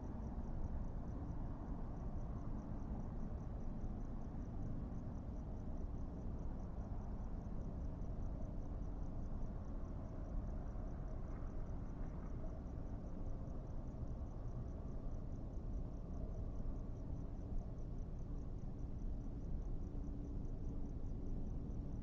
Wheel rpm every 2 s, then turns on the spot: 0, 0, 0, 0, 0, 0, 0, 0, 0, 0, 0.
none